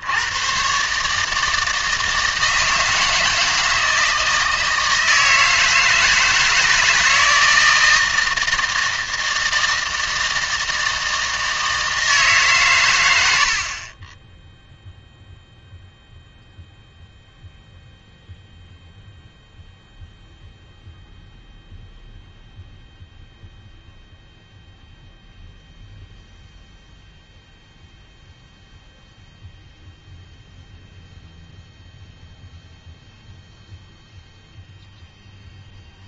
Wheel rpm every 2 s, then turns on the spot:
130, 160, 160, 160, 160, 160, 120, 0, 0, 0, 0, 0, 0, 0, 0, 0, 0, 0.
none